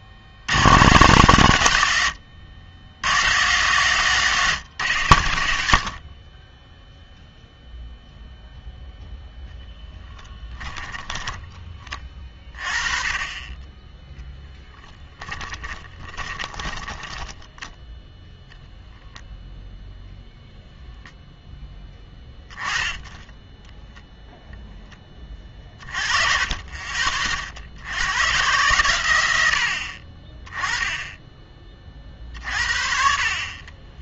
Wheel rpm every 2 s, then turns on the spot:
100, 90, 140, 10, 0, 10, 30, 0, 20, 0, 0, 10, 0, 30, 120, 20, 50.
10-12 16-18